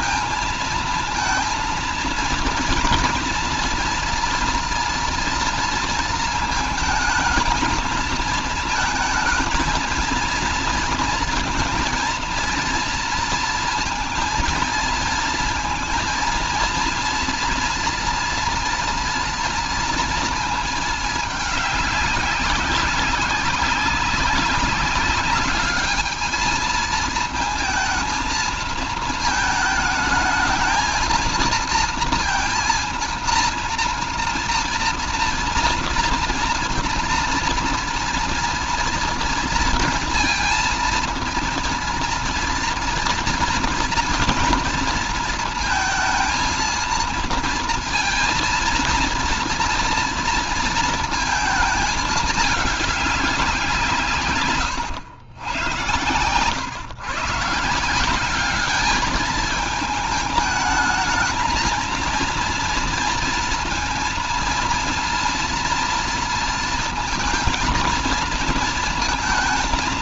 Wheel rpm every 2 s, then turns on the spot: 230, 230, 230, 220, 220, 220, 230, 230, 230, 230, 220, 190, 200, 220, 220, 220, 230, 230, 230, 240, 230, 230, 230, 230, 230, 230, 200, 120, 120, 200, 220, 230, 230, 230, 230.
none